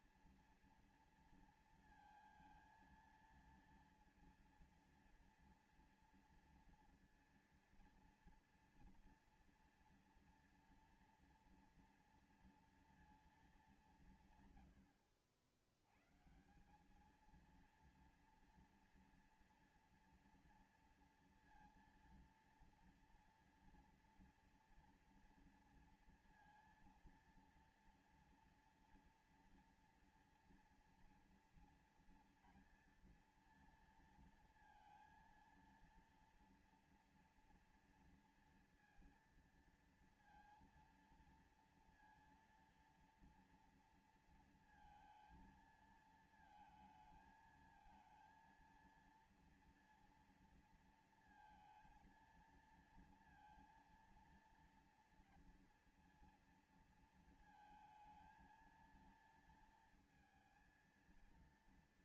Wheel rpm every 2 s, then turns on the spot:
230, 230, 230, 230, 230, 230, 230, 150, 130, 230, 230, 230, 230, 230, 230, 230, 230, 230, 230, 230, 230, 230, 230, 220, 230, 230, 230, 230, 230, 230, 230.
none